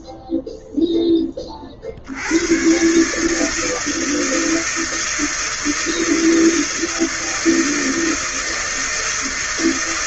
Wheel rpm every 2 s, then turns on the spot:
0, 100, 160, 160, 160.
none